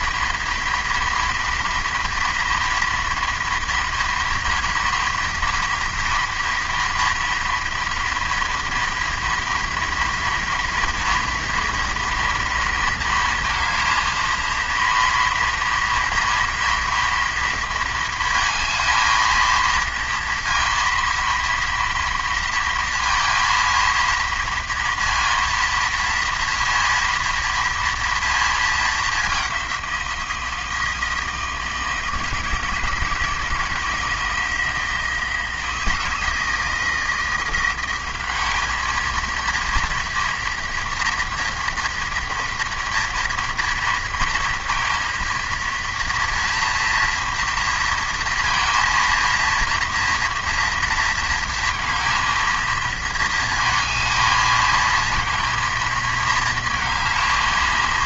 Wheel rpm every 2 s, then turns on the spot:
230, 230, 230, 230, 230, 230, 230, 230, 230, 230, 230, 230, 230, 230, 220, 170, 160, 160, 160, 210, 230, 230, 230, 230, 230, 230, 220, 220, 230.
none